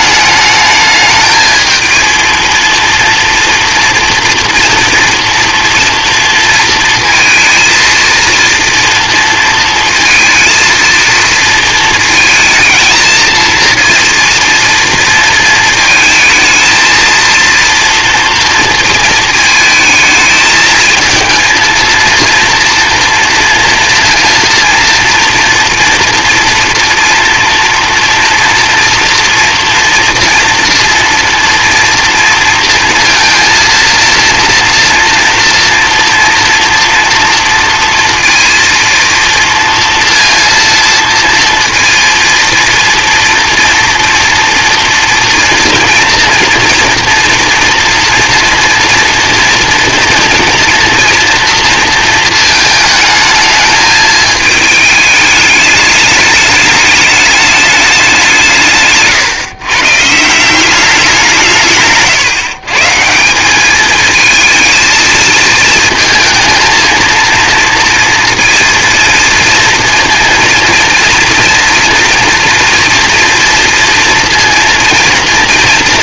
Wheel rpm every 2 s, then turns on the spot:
210, 230, 240, 230, 230, 230, 220, 230, 220, 230, 220, 240, 230, 230, 230, 230, 230, 230, 240, 230, 230, 230, 230, 230, 230, 230, 220, 220, 210, 160, 180, 150, 220, 230, 230, 230, 230, 230.
none